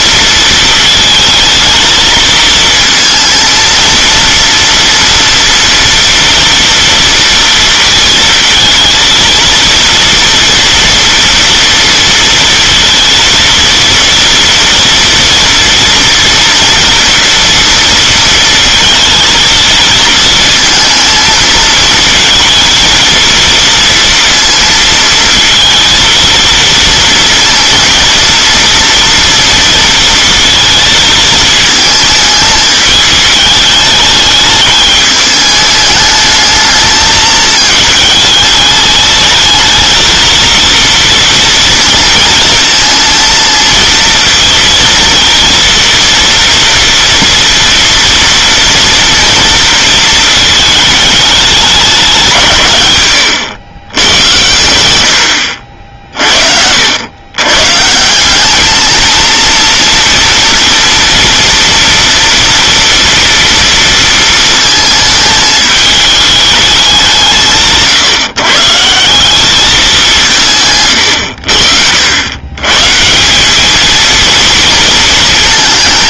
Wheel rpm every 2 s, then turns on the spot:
220, 230, 230, 230, 230, 230, 230, 230, 230, 230, 230, 230, 230, 230, 230, 230, 220, 210, 220, 210, 230, 230, 230, 230, 230, 220, 150, 100, 60, 200, 230, 230, 220, 210, 150, 140, 130, 230.
none